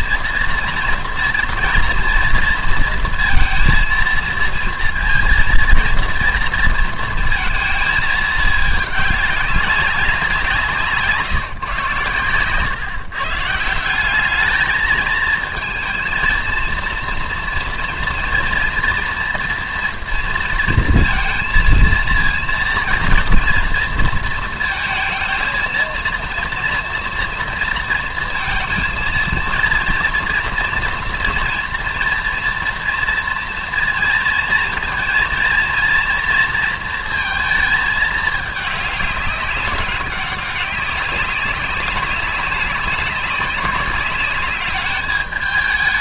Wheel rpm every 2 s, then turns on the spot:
230, 230, 230, 230, 220, 170, 120, 210, 230, 230, 230, 230, 230, 230, 230, 230, 230, 230, 230, 210, 200, 200, 200.
none